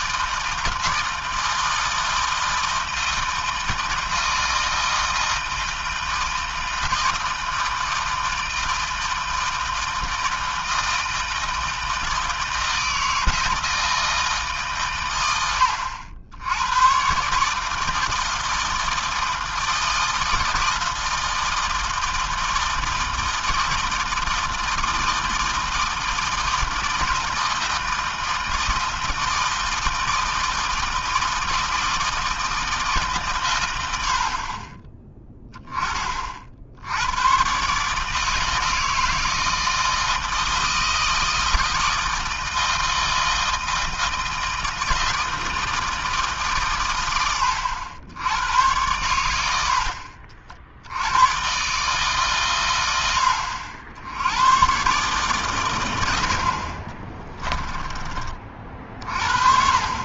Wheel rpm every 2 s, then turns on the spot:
160, 160, 160, 160, 160, 160, 160, 120, 130, 160, 160, 160, 160, 160, 160, 160, 150, 20, 100, 160, 160, 160, 160, 110, 100, 100, 90, 130, 20, 40.
56-58